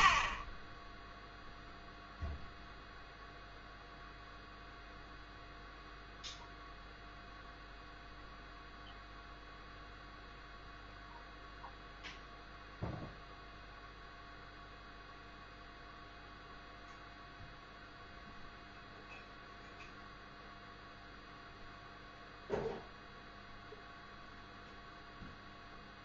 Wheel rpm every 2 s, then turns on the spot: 10, 0, 0, 0, 0, 0, 0, 0, 0, 0, 0, 0, 0.
none